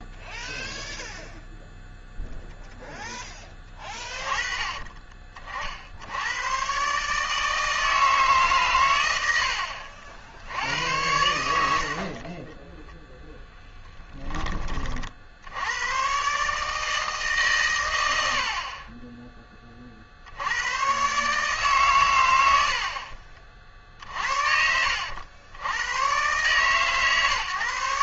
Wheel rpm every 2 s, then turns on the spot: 0, 0, 30, 120, 130, 80, 10, 20, 140, 60, 80, 80, 60, 130.
12-14